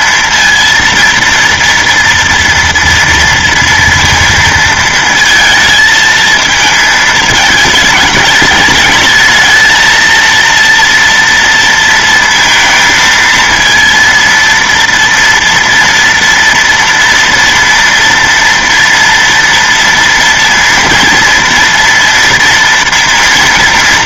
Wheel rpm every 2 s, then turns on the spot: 230, 230, 230, 220, 210, 230, 220, 230, 230, 240, 230, 240.
none